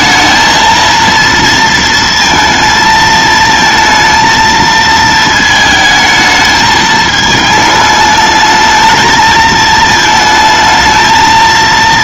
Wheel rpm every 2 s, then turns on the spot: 230, 220, 220, 220, 220, 220.
none